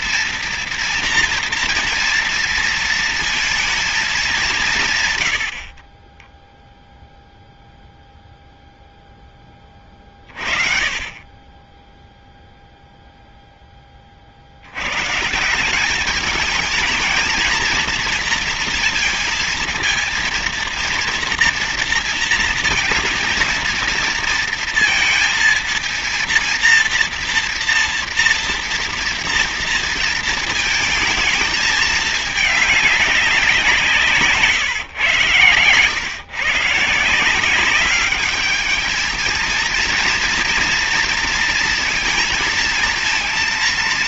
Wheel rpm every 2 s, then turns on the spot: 230, 230, 180, 10, 0, 40, 0, 70, 220, 230, 230, 230, 230, 230, 230, 230, 210, 160, 140, 210, 230, 230.
6-8